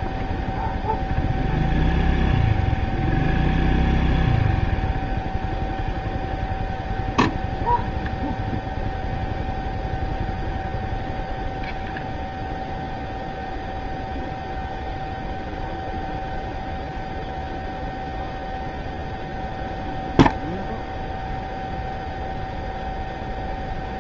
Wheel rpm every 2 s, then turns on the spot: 0, 0, 0, 0, 0, 0, 0, 0, 0, 0, 0, 0.
none